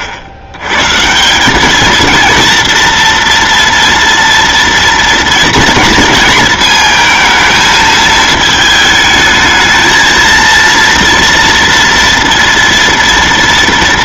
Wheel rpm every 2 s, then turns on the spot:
110, 230, 230, 230, 220, 230, 230.
none